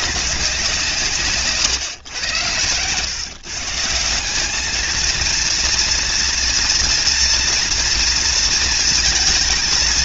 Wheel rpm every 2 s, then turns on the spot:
160, 120, 230, 230, 230.
none